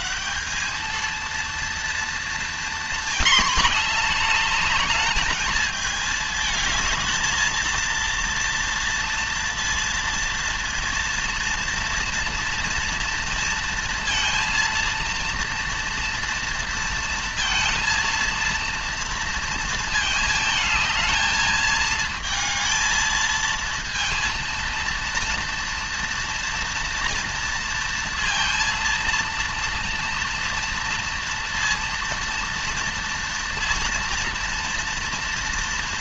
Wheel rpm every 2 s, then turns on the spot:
210, 230, 220, 220, 230, 230, 230, 230, 230, 230, 220, 220, 230, 230, 230, 230, 230, 230.
none